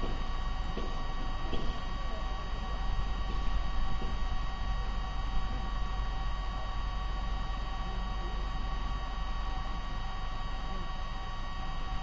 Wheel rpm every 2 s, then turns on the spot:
0, 0, 0, 0, 0, 0.
none